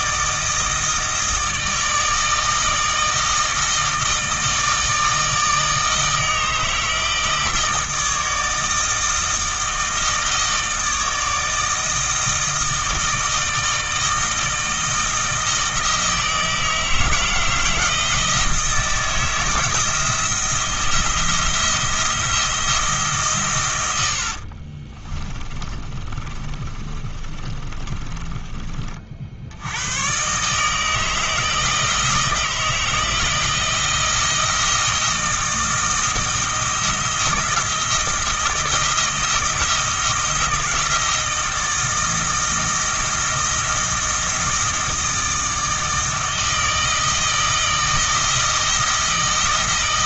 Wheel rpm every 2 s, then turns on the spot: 160, 160, 160, 160, 160, 160, 160, 160, 160, 160, 170, 160, 40, 30, 30, 150, 160, 160, 160, 160, 160, 160, 160, 160, 160.
24-28